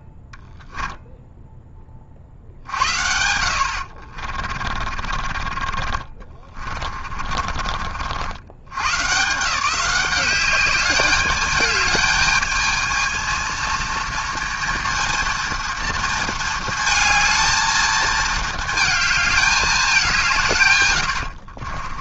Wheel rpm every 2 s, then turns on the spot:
0, 70, 30, 40, 130, 200, 220, 230, 220, 220, 130.
2-8